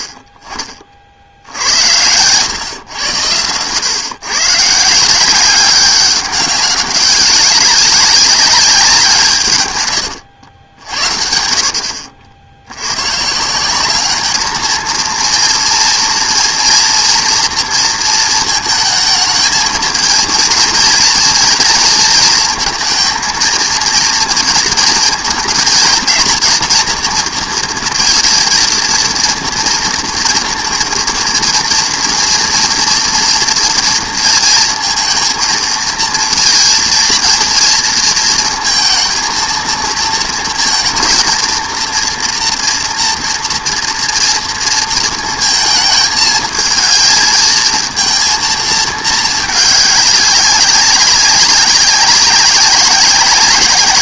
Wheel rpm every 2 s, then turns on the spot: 50, 110, 140, 190, 200, 80, 70, 210, 230, 230, 230, 230, 230, 230, 230, 230, 240, 230, 230, 230, 230, 240, 230, 220, 230, 200, 190.
none